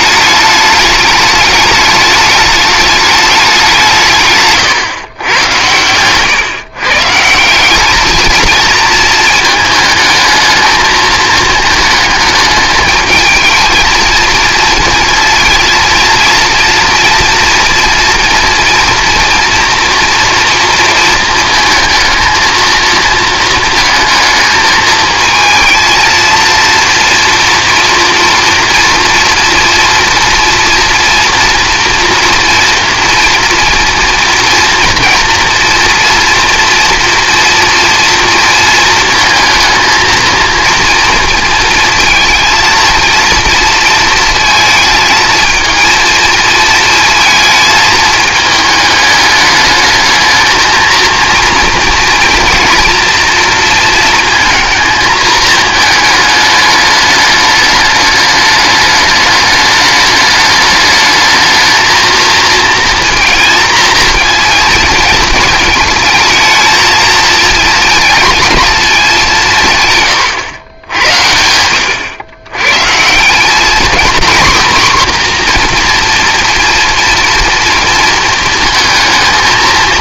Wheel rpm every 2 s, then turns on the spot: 210, 210, 130, 150, 230, 220, 220, 230, 230, 230, 230, 230, 220, 230, 230, 230, 230, 230, 230, 230, 230, 230, 230, 220, 210, 230, 230, 230, 210, 210, 210, 230, 230, 230, 210, 100, 140, 250, 230, 220.
none